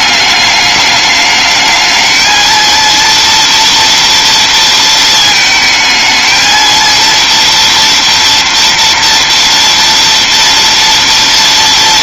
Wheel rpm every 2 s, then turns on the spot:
210, 230, 220, 230, 230, 230.
none